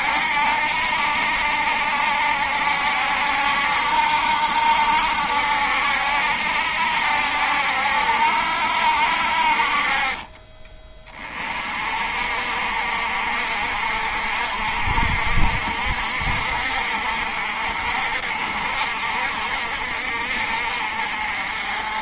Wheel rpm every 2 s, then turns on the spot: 70, 70, 70, 70, 60, 30, 50, 60, 60, 60, 50.
none